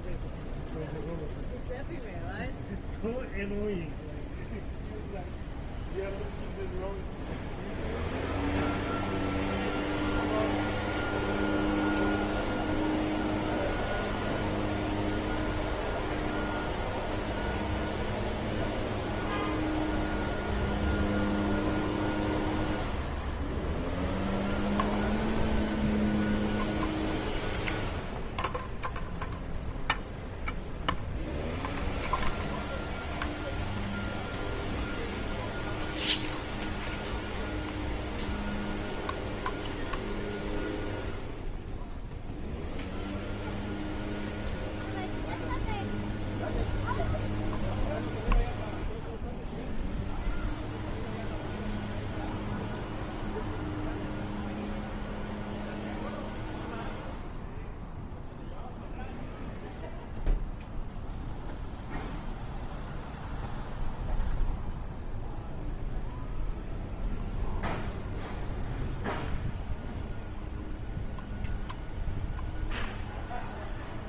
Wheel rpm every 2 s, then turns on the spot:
0, 0, 0, 0, 0, 0, 0, 0, 0, 0, 0, 0, 0, 0, 0, 0, 0, 0, 0, 0, 0, 0, 0, 0, 0, 0, 0, 0, 0, 0, 0, 0, 0, 0, 0, 0, 0.
none